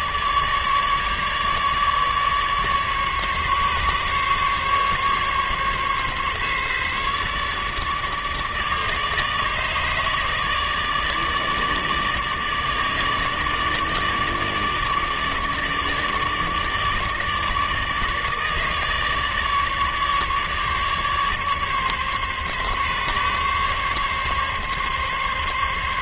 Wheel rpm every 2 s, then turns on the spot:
150, 150, 140, 140, 150, 150, 150, 150, 150, 150, 150, 140, 140.
none